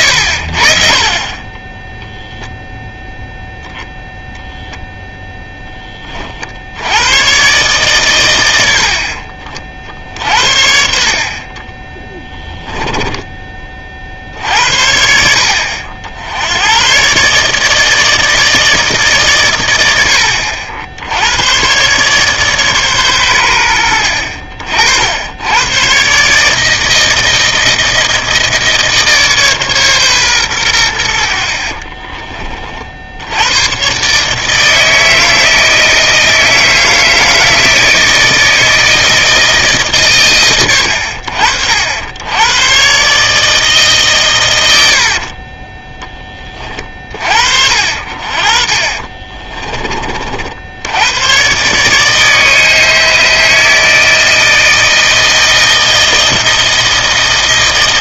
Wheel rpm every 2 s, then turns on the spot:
70, 0, 0, 60, 80, 60, 10, 60, 90, 160, 70, 140, 50, 150, 160, 110, 30, 150, 160, 160, 100, 110, 100, 30, 40, 80, 150, 160, 160.
12-14 48-50